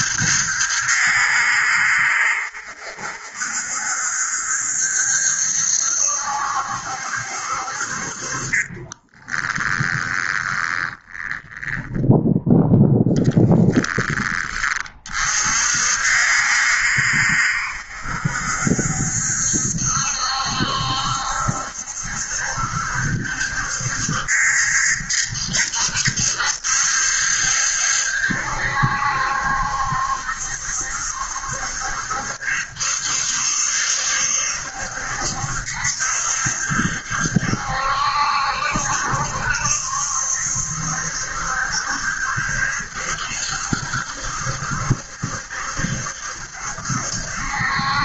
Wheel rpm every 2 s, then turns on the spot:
70, 70, 70, 70, 20, 20, 0, 30, 70, 70, 70, 70, 70, 70, 70, 70, 70, 70, 70, 70, 70, 70, 70, 70.
8-12